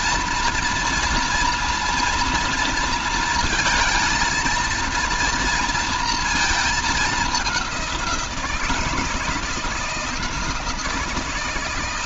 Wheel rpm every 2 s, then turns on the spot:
230, 230, 230, 220, 160, 160.
none